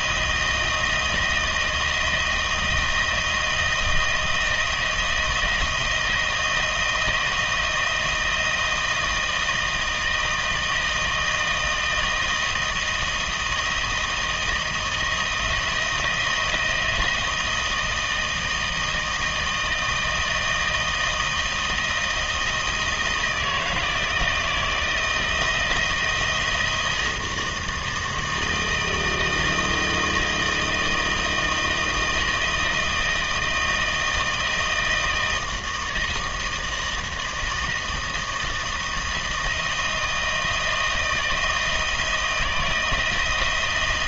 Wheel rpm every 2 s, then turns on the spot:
170, 160, 170, 160, 160, 160, 160, 170, 170, 160, 160, 160, 160, 160, 160, 160, 160, 160, 160, 160, 160, 160.
none